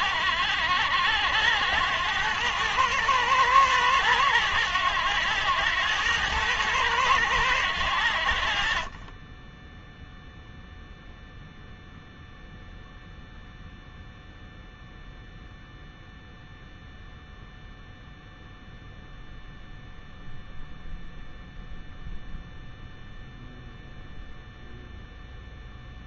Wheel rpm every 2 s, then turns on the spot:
80, 110, 100, 100, 30, 0, 0, 0, 0, 0, 0, 0, 0.
none